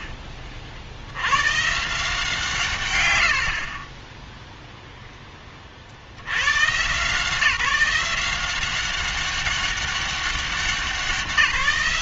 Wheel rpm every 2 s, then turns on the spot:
50, 120, 0, 120, 190, 190.
none